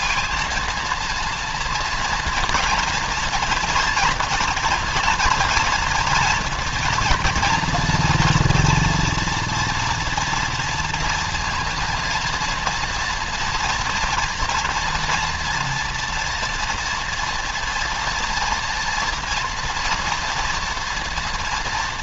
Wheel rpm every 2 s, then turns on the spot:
230, 230, 230, 240, 240, 230, 230, 230, 230, 230, 230.
none